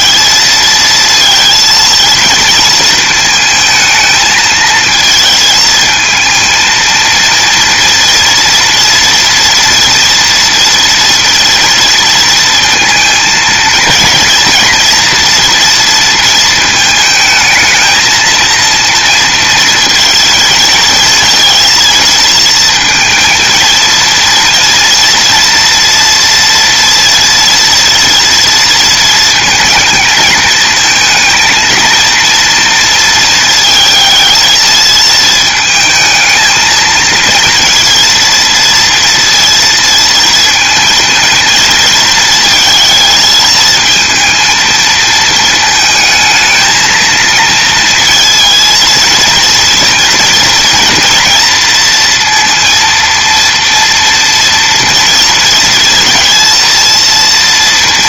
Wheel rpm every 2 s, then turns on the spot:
230, 230, 220, 230, 240, 230, 230, 230, 220, 230, 220, 230, 230, 230, 230, 230, 230, 220, 230, 230, 230, 230, 230, 220, 230, 230, 230, 230, 230.
none